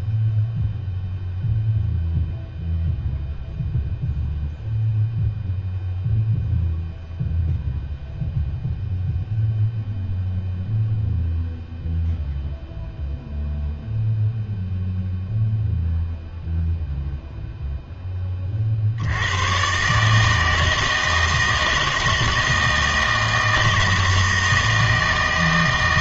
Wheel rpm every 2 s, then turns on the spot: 0, 0, 0, 0, 0, 0, 0, 0, 0, 40, 160, 160, 160.
none